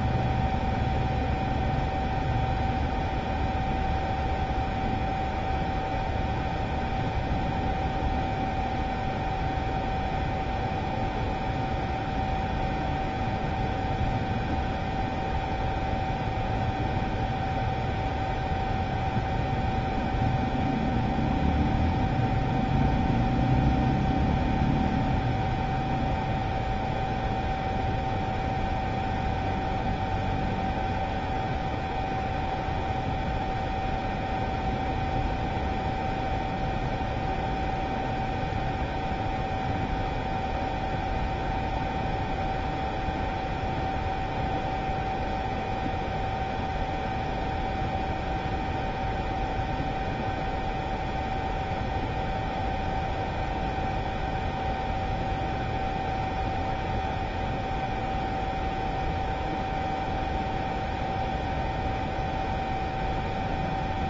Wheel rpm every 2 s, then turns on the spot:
0, 0, 0, 0, 0, 0, 0, 0, 0, 0, 0, 0, 0, 0, 0, 0, 0, 0, 0, 0, 0, 0, 0, 0, 0, 0, 0, 0, 0, 0, 0, 0.
none